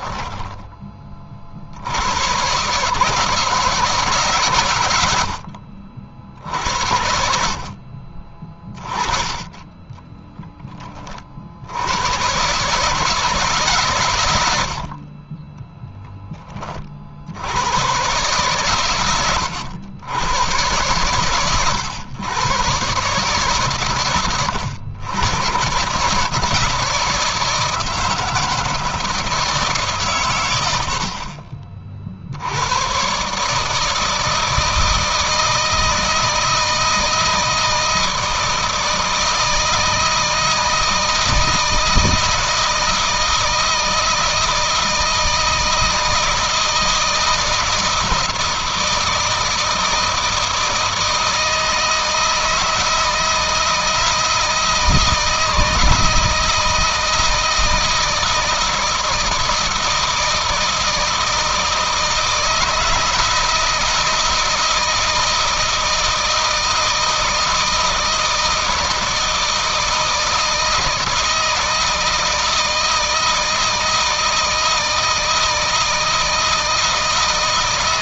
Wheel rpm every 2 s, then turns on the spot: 20, 140, 110, 70, 30, 20, 150, 70, 40, 120, 120, 130, 110, 160, 160, 90, 110, 160, 160, 160, 160, 160, 160, 160, 160, 160, 170, 160, 160, 160, 160, 160, 160, 160, 160, 160, 160, 160, 160.
none